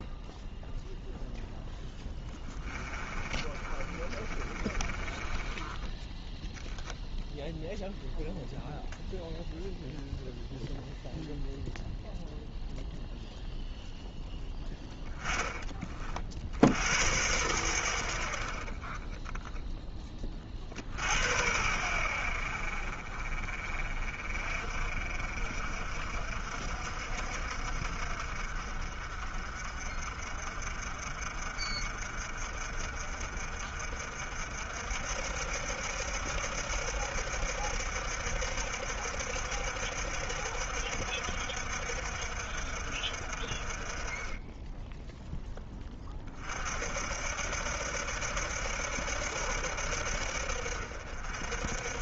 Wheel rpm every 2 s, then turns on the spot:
0, 20, 20, 0, 0, 0, 0, 10, 70, 40, 80, 50, 50, 60, 50, 50, 50, 60, 70, 70, 60, 50, 10, 60, 70, 60.
2-6